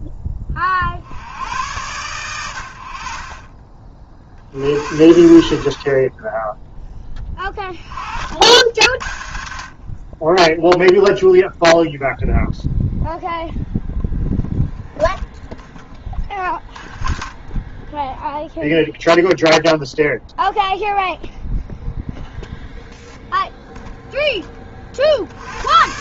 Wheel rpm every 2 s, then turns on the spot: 60, 70, 50, 10, 80, 0, 0, 0, 20, 0, 0, 0, 40.
none